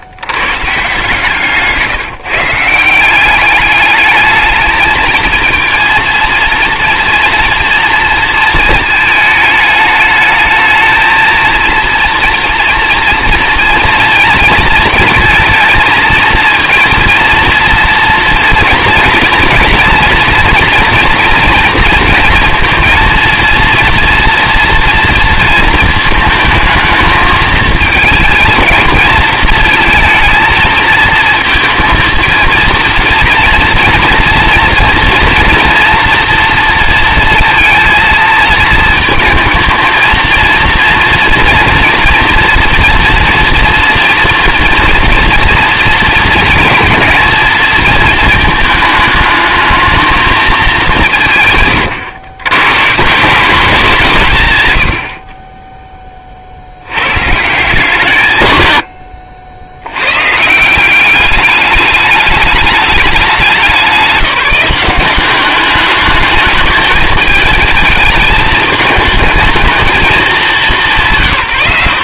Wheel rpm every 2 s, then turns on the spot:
140, 170, 220, 230, 220, 220, 230, 220, 230, 230, 230, 230, 230, 220, 230, 220, 230, 230, 230, 220, 230, 230, 230, 220, 220, 190, 140, 120, 70, 110, 170, 210, 180, 210, 220, 180.
none